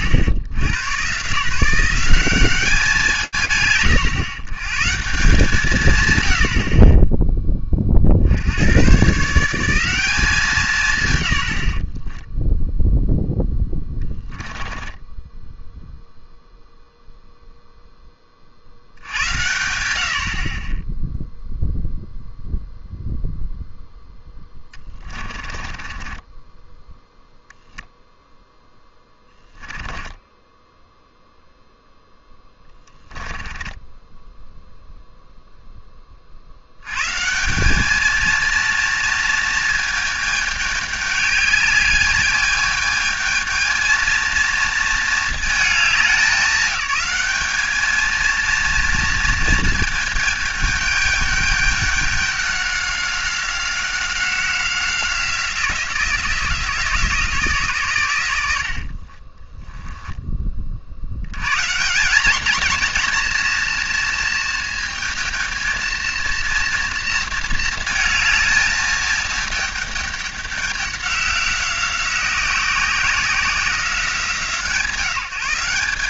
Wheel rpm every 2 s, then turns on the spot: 110, 180, 130, 60, 110, 170, 10, 10, 0, 80, 10, 0, 20, 0, 10, 10, 10, 0, 130, 230, 210, 220, 230, 200, 230, 210, 190, 180, 160, 50, 70, 230, 230, 230, 220, 200, 180, 150.
14-16 24-26 28-30 32-34 58-60